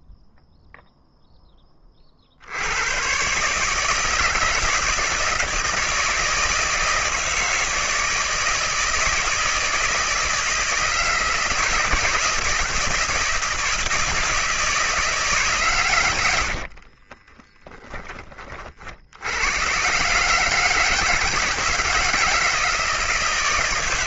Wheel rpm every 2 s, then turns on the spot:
0, 100, 160, 160, 160, 160, 170, 160, 50, 60, 160, 160.
16-18